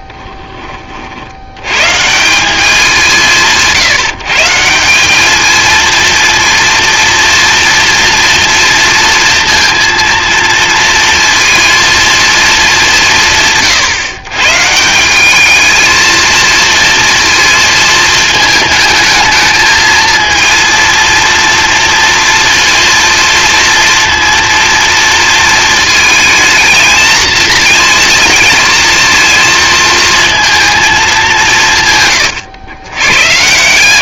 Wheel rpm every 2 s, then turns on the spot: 30, 190, 170, 230, 230, 230, 210, 150, 230, 220, 230, 230, 230, 220, 230, 220, 110.
none